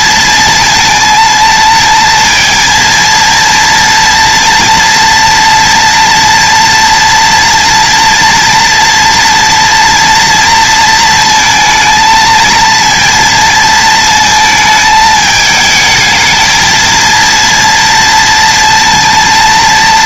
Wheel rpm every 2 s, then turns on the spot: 230, 230, 240, 230, 230, 230, 230, 220, 230, 230.
none